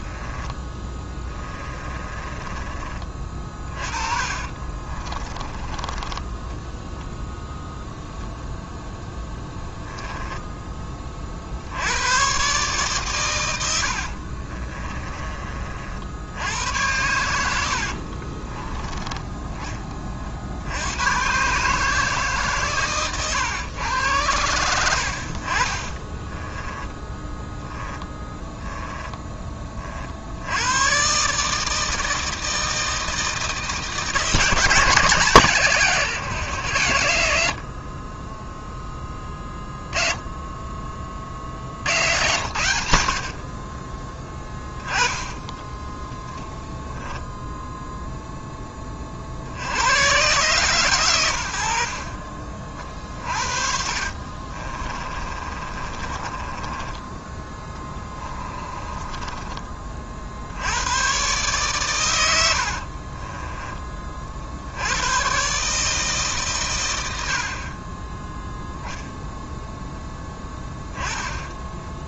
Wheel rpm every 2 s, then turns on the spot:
10, 20, 30, 10, 0, 10, 140, 30, 90, 30, 70, 130, 90, 20, 10, 90, 160, 170, 120, 10, 20, 70, 10, 0, 10, 140, 50, 30, 20, 20, 80, 60, 70, 130, 0, 10.
0-6 14-16 18-20 24-30 44-46 54-60 62-64